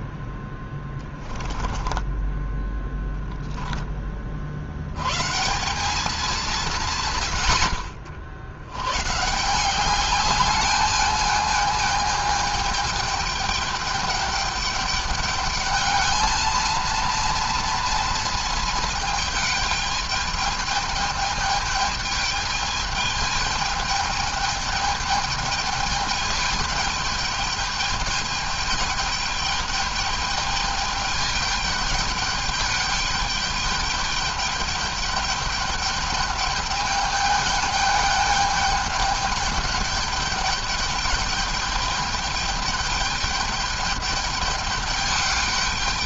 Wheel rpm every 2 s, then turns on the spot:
20, 10, 40, 180, 60, 200, 210, 210, 220, 220, 210, 210, 210, 210, 210, 210, 210, 210, 210, 210, 210, 210, 210.
0-4